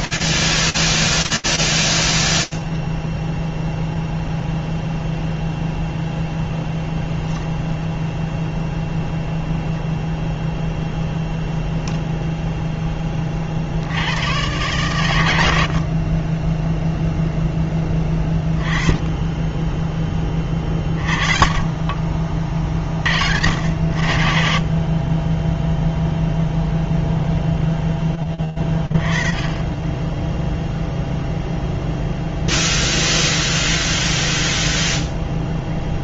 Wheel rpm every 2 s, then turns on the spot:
0, 0, 0, 0, 0, 0, 0, 120, 10, 10, 30, 40, 30, 0, 20, 0, 0, 0.
none